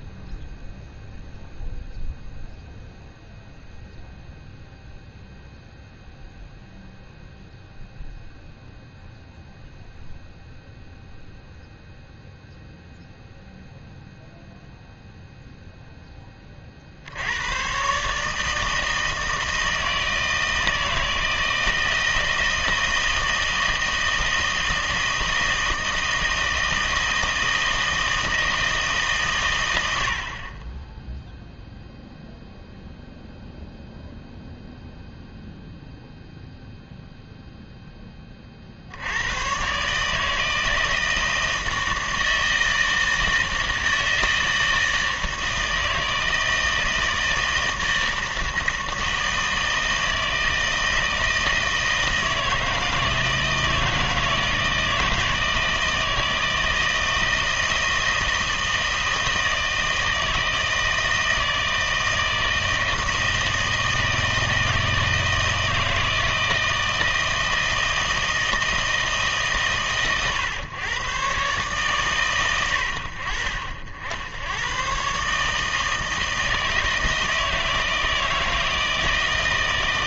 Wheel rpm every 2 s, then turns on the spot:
0, 0, 0, 0, 0, 0, 0, 0, 40, 160, 160, 160, 160, 160, 160, 30, 0, 0, 0, 50, 160, 160, 160, 160, 160, 160, 160, 160, 160, 160, 160, 160, 160, 160, 160, 130, 90, 110, 160, 160.
none